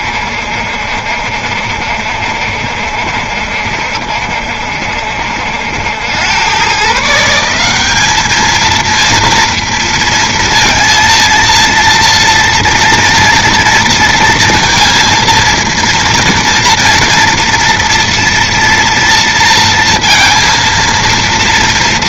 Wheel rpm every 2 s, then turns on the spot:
70, 70, 70, 90, 200, 230, 230, 230, 230, 230, 230.
none